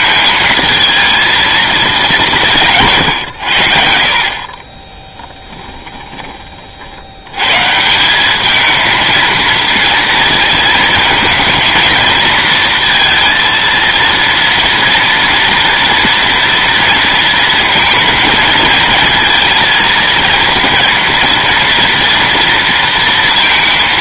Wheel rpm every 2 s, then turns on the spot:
230, 130, 10, 100, 230, 230, 230, 240, 230, 230, 230, 230.
4-6